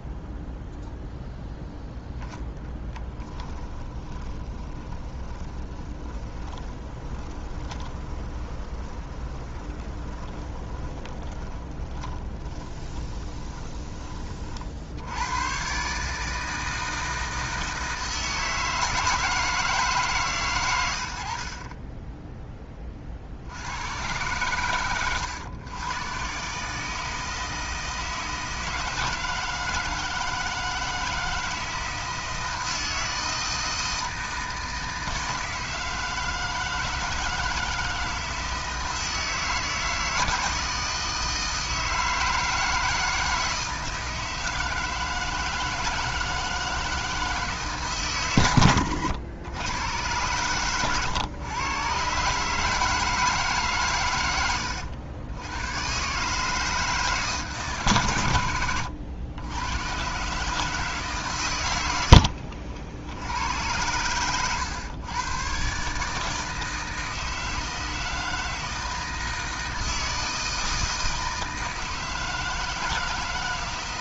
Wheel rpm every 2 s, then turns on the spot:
0, 10, 20, 20, 20, 20, 20, 70, 160, 160, 100, 30, 110, 150, 160, 160, 160, 160, 160, 160, 160, 160, 160, 160, 100, 110, 160, 90, 150, 90, 150, 60, 120, 160, 160, 160, 160.
2-14 24-26 48-50